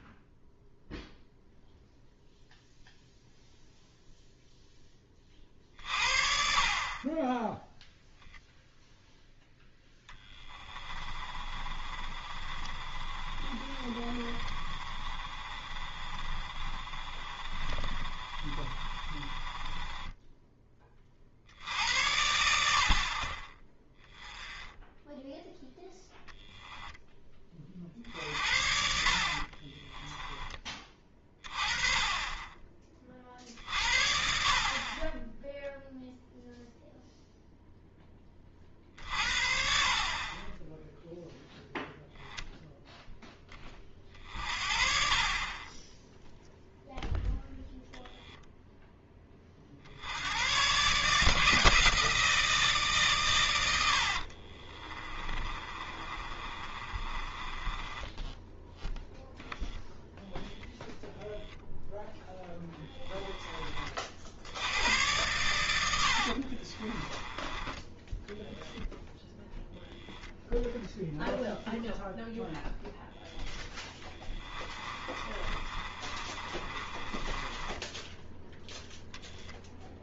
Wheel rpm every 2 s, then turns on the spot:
0, 0, 10, 40, 0, 20, 30, 30, 30, 30, 20, 50, 10, 0, 50, 30, 30, 40, 0, 50, 10, 0, 30, 0, 0, 130, 150, 40, 30, 10, 0, 10, 100, 30, 0, 10, 0, 20, 20, 0.
10-20 54-58 66-68 74-78